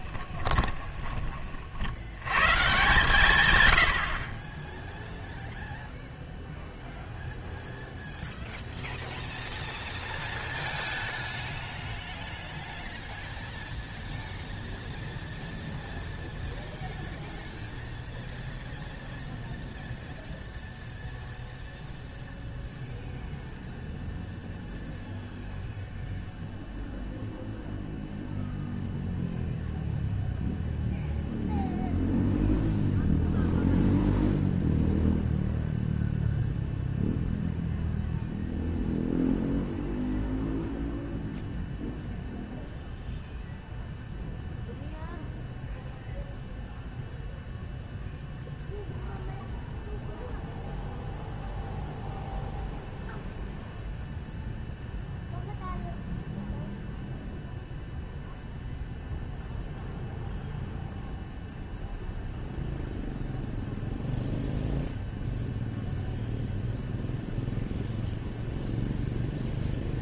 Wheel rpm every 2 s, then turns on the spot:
20, 150, 10, 0, 0, 0, 0, 0, 0, 0, 0, 0, 0, 0, 0, 0, 0, 0, 0, 0, 0, 0, 0, 0, 0, 0, 0, 0, 0, 0, 0, 0, 0, 0, 0.
0-2